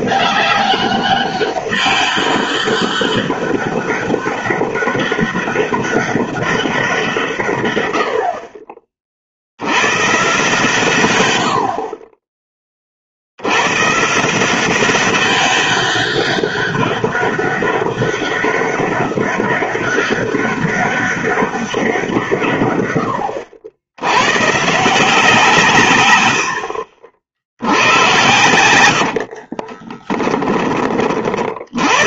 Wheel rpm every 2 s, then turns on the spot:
200, 200, 200, 190, 40, 130, 20, 180, 200, 200, 200, 110, 150, 70, 90, 20.
28-30